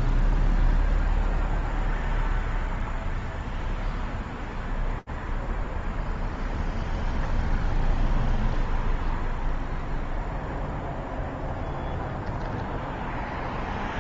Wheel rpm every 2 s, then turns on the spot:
0, 0, 0, 0, 0, 0, 0.
none